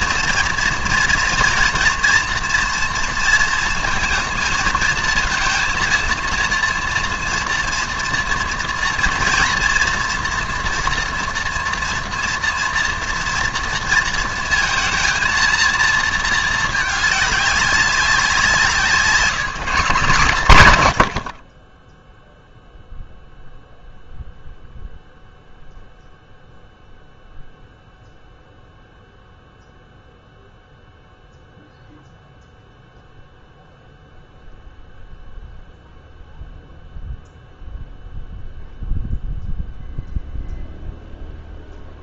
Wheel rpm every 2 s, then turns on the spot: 230, 230, 220, 230, 230, 230, 230, 230, 220, 170, 140, 0, 0, 0, 0, 0, 0, 0, 0, 0, 0.
none